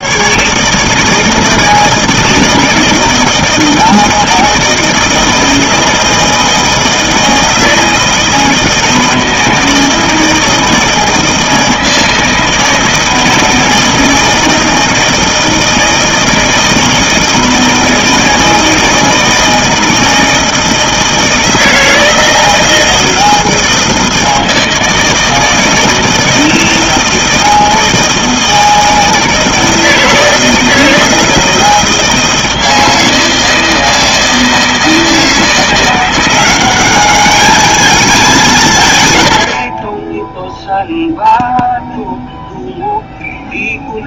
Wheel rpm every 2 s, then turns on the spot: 160, 160, 160, 160, 160, 160, 160, 160, 160, 160, 160, 160, 160, 160, 160, 160, 160, 160, 190, 150, 0, 0.
none